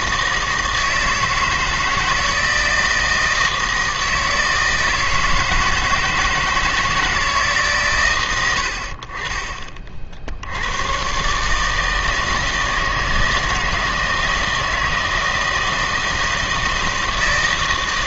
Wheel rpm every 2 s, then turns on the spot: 160, 160, 160, 160, 70, 100, 160, 160, 160.
none